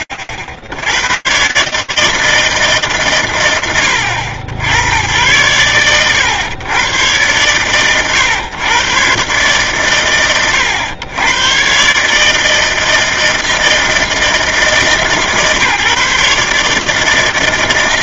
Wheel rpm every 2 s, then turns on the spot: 80, 150, 100, 120, 120, 100, 160, 160, 150.
none